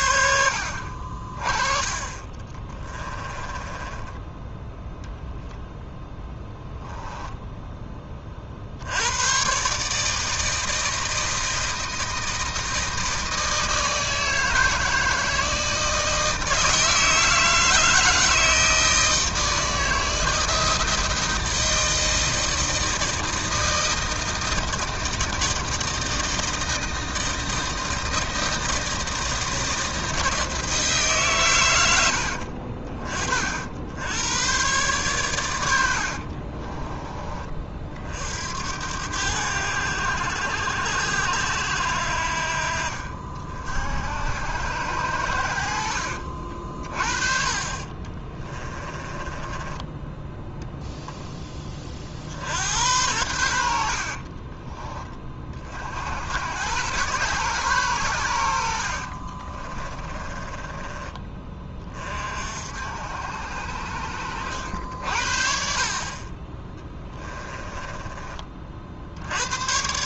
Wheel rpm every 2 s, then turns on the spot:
70, 30, 10, 0, 60, 160, 160, 160, 160, 160, 160, 160, 160, 160, 160, 160, 50, 120, 30, 80, 80, 60, 90, 50, 20, 20, 80, 30, 100, 90, 20, 60, 70, 20, 40.
0-4 36-38 48-50 54-56 58-62